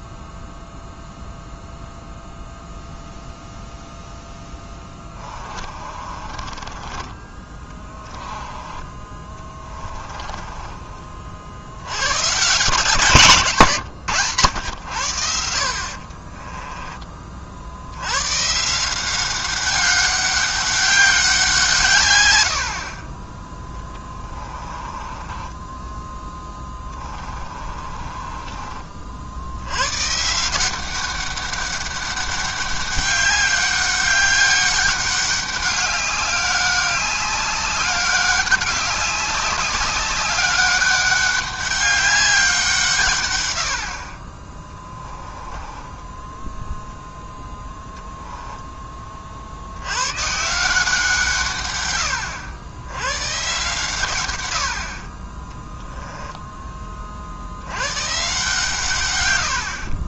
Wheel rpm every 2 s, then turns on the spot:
0, 0, 10, 20, 20, 20, 150, 90, 20, 160, 200, 50, 20, 20, 40, 180, 200, 200, 200, 200, 200, 160, 10, 0, 20, 170, 90, 70, 20, 140.
4-12 16-18 24-28 44-46